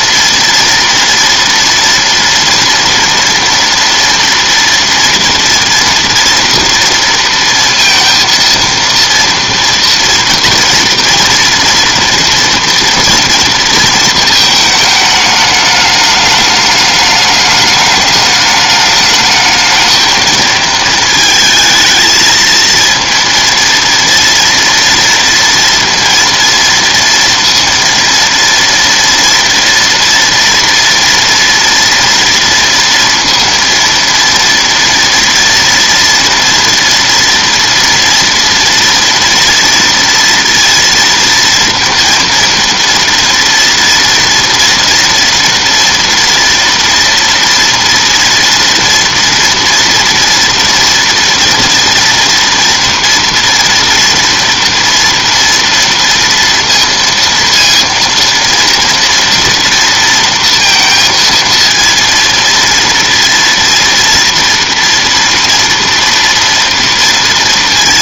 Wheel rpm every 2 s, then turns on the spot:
230, 230, 240, 230, 230, 230, 230, 220, 210, 210, 220, 230, 230, 230, 230, 230, 230, 230, 230, 230, 230, 230, 240, 230, 240, 230, 230, 230, 230, 230, 230, 230, 230, 230.
none